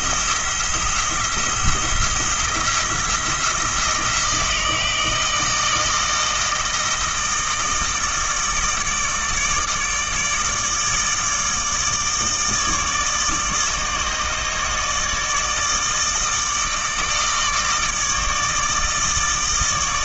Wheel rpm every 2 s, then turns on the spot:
170, 170, 160, 160, 160, 160, 160, 150, 160, 160.
none